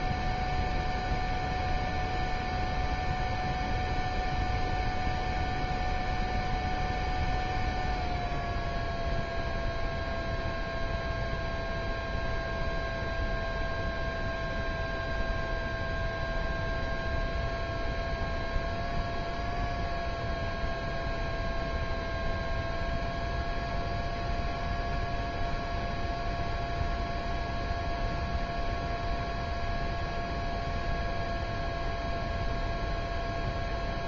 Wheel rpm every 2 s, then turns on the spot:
0, 0, 0, 0, 0, 0, 0, 0, 0, 0, 0, 0, 0, 0, 0, 0, 0.
none